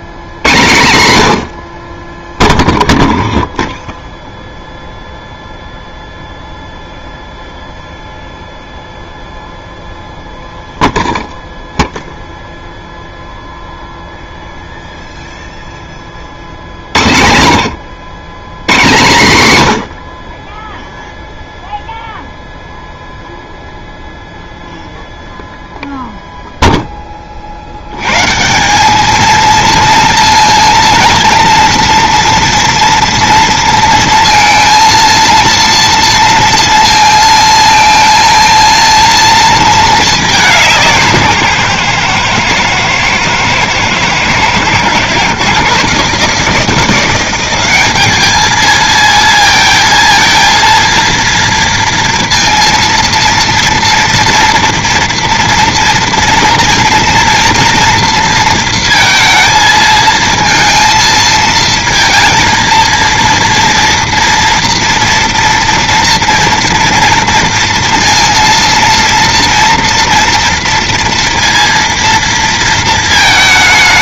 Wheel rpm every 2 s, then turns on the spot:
130, 0, 0, 0, 0, 0, 0, 0, 50, 120, 20, 0, 0, 0, 170, 230, 230, 230, 230, 230, 180, 120, 120, 160, 210, 230, 230, 240, 230, 230, 230, 230, 230, 230, 230, 230, 230.
none